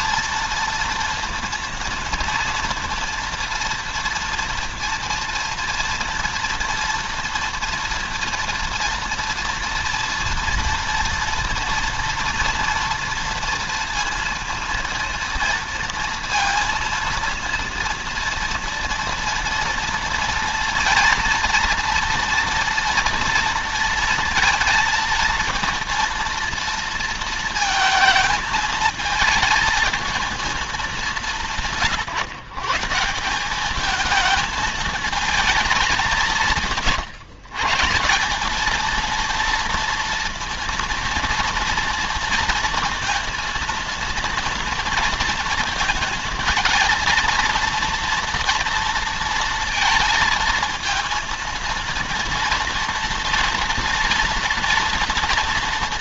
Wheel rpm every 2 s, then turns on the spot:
230, 230, 230, 230, 230, 230, 240, 230, 230, 230, 230, 230, 230, 230, 220, 210, 160, 220, 160, 220, 230, 230, 230, 230, 230, 230, 230, 230.
none